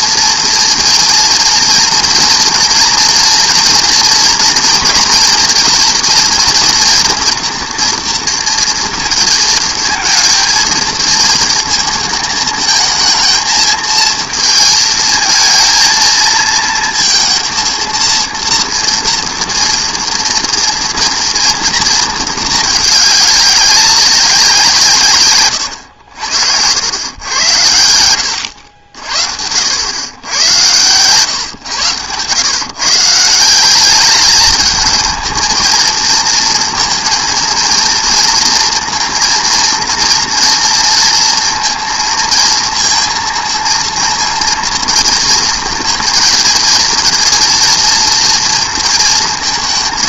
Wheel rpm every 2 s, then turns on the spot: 230, 230, 230, 230, 230, 230, 220, 220, 230, 230, 230, 220, 170, 80, 90, 110, 130, 210, 230, 230, 230, 230, 230, 230, 230.
none